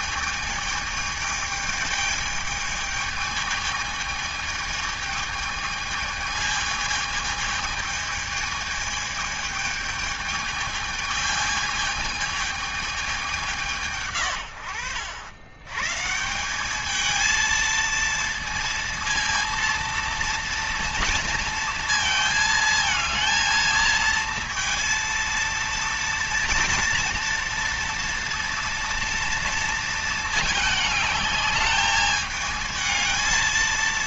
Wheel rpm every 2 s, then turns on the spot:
210, 220, 220, 220, 210, 220, 210, 80, 220, 230, 230, 220, 230, 230, 230, 210, 220.
none